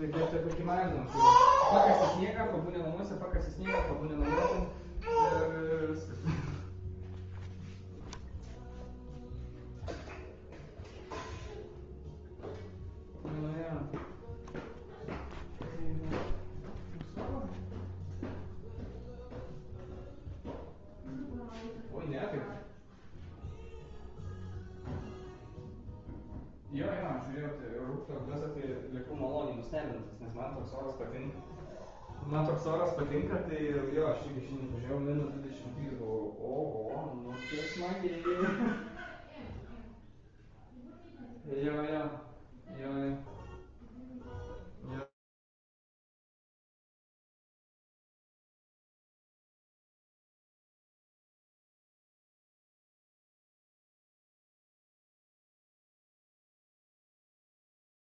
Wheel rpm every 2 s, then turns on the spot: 0, 0, 0, 0, 0, 0, 0, 0, 0, 0, 0, 0, 0, 0, 0, 0, 0, 0, 0, 0, 0, 0, 0, 0, 0, 0, 0, 0, 0.
none